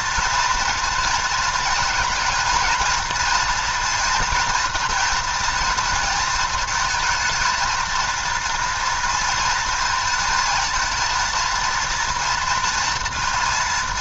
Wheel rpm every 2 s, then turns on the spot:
230, 230, 230, 220, 230, 230, 230.
none